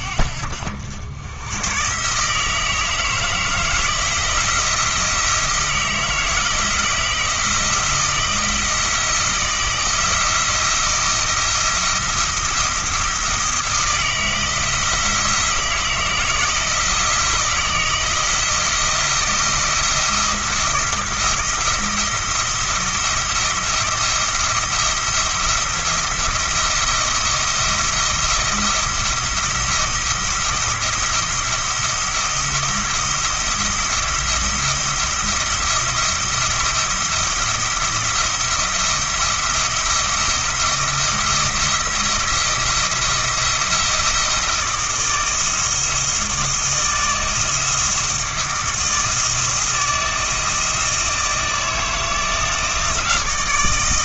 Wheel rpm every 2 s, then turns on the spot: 80, 160, 160, 170, 160, 170, 170, 160, 160, 170, 170, 170, 170, 170, 170, 170, 170, 170, 170, 170, 170, 170, 170, 160, 170, 160, 160.
none